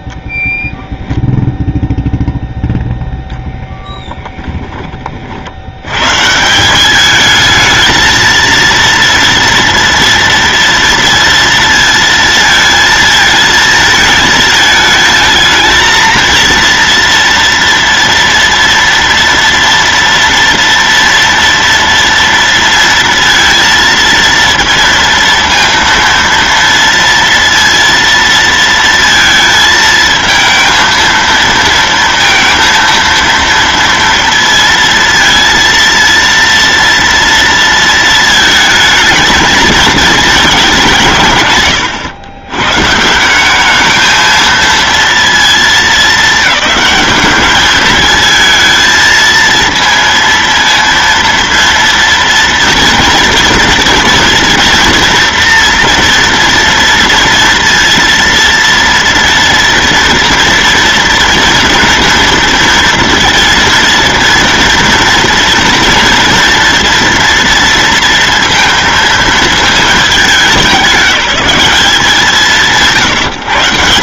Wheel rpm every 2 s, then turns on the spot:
0, 0, 30, 180, 230, 230, 220, 220, 230, 230, 230, 230, 230, 230, 230, 220, 230, 230, 230, 220, 190, 140, 230, 210, 230, 230, 230, 240, 230, 230, 230, 240, 240, 230, 230, 200, 170.
4-6